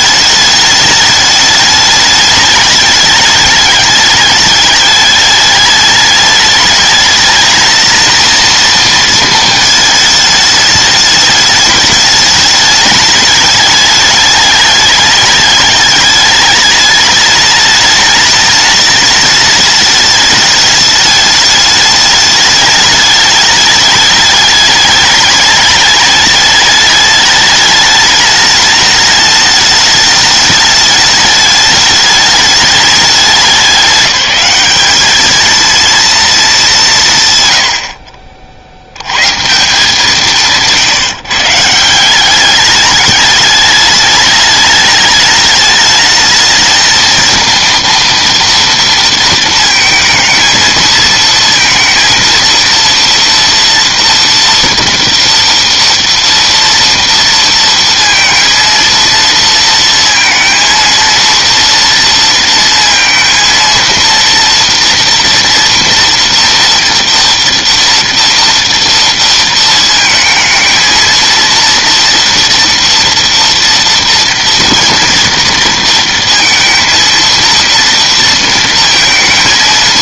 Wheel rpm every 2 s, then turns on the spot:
210, 210, 210, 210, 230, 210, 210, 210, 210, 210, 210, 210, 210, 210, 210, 210, 210, 200, 200, 60, 160, 200, 210, 220, 230, 220, 230, 230, 230, 230, 230, 230, 230, 230, 230, 220, 230, 230, 230, 230.
none